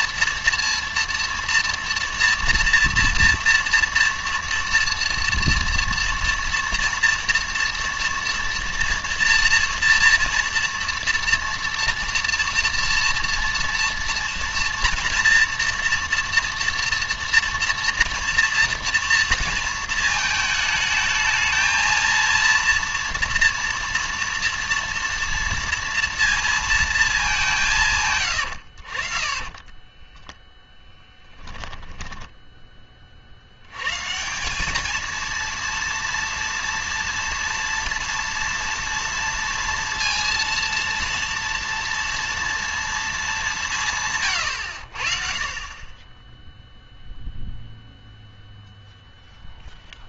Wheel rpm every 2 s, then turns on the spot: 230, 230, 230, 230, 230, 230, 230, 230, 230, 230, 220, 230, 230, 230, 70, 10, 20, 210, 230, 230, 230, 230, 80, 0, 0.
28-32